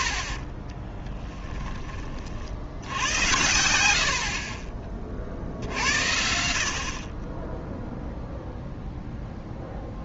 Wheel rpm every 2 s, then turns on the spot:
50, 70, 40, 60, 0.
4-6